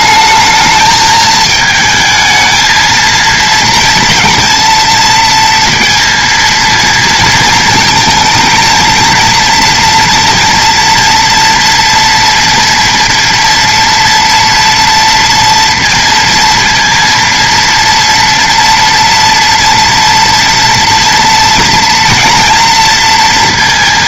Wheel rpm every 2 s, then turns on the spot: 220, 220, 230, 230, 230, 230, 230, 230, 230, 230, 230, 230.
none